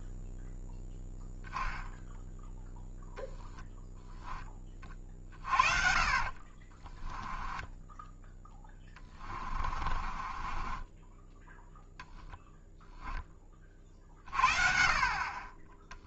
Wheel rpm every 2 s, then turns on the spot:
0, 0, 20, 30, 20, 20, 0, 40.
6-12